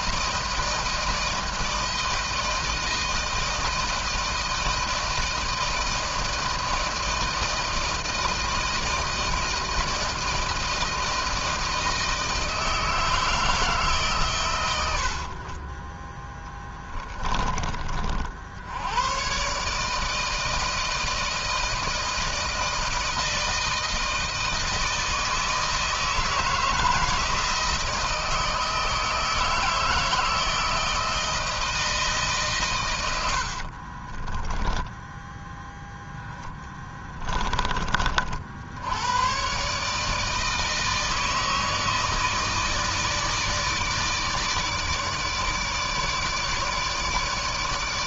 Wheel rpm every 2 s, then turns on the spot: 160, 160, 160, 160, 160, 160, 160, 100, 10, 90, 160, 160, 160, 160, 160, 160, 120, 10, 20, 90, 160, 160, 150, 150.
16-18 34-38